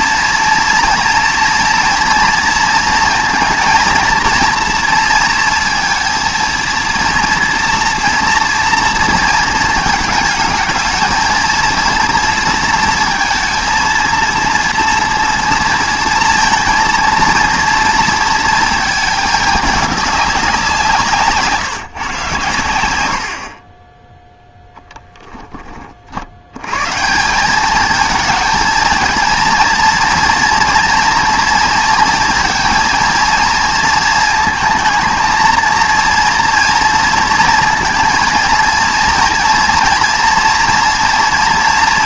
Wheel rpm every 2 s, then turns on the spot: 230, 230, 230, 230, 230, 220, 230, 230, 230, 220, 170, 100, 10, 120, 230, 230, 230, 220, 230, 230, 230.
none